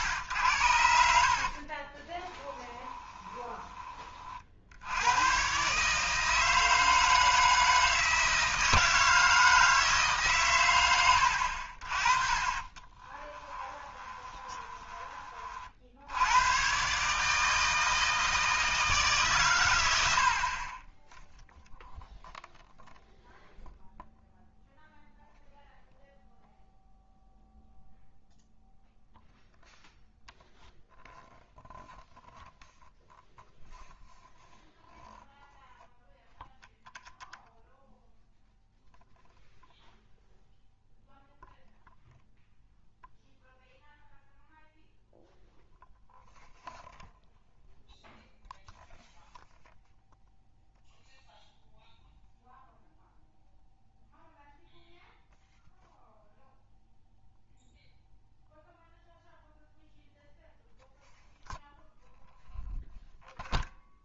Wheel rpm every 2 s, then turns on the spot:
80, 10, 70, 160, 160, 120, 30, 20, 120, 160, 30, 0, 0, 0, 0, 0, 0, 0, 0, 0, 0, 0, 0, 0, 0, 0, 0, 0, 0, 0, 0, 0.
2-4 12-16